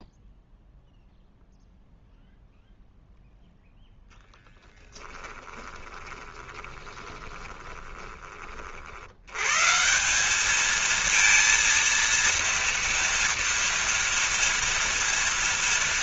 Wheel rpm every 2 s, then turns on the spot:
0, 0, 10, 20, 60, 220, 240, 230.
4-8